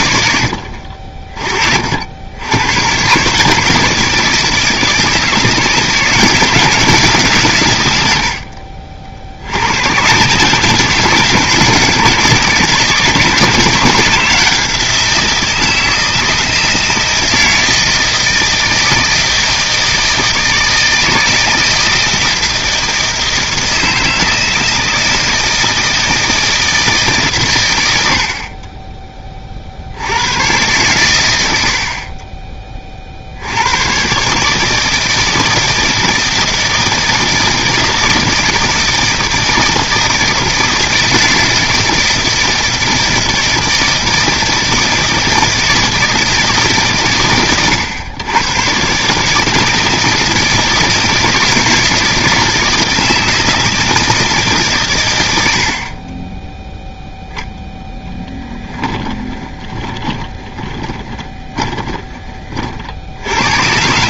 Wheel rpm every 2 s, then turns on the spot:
40, 150, 170, 130, 60, 160, 160, 170, 160, 160, 160, 160, 160, 130, 20, 100, 60, 160, 160, 160, 160, 160, 160, 120, 150, 160, 170, 100, 0, 10, 20, 50.
58-62